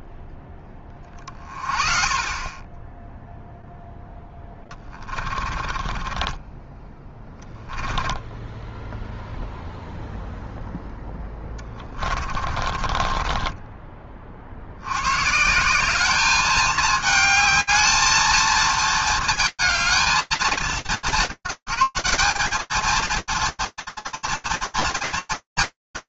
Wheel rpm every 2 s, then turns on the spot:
0, 30, 0, 20, 10, 0, 20, 30, 200, 220, 210, 190, 220.
6-10 12-14